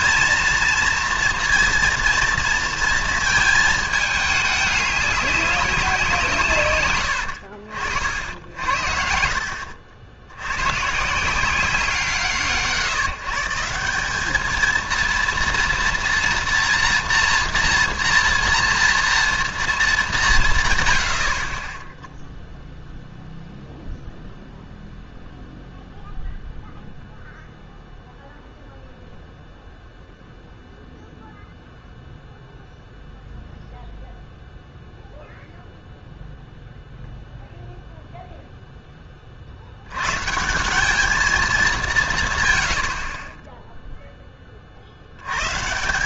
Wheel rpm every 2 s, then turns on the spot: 230, 230, 210, 140, 70, 110, 160, 220, 230, 230, 150, 0, 0, 0, 0, 0, 0, 0, 0, 0, 170, 110, 40.
none